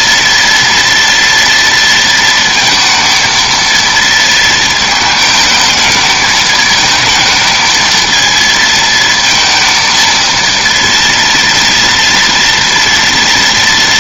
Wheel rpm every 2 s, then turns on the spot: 230, 230, 230, 220, 220, 230, 230.
none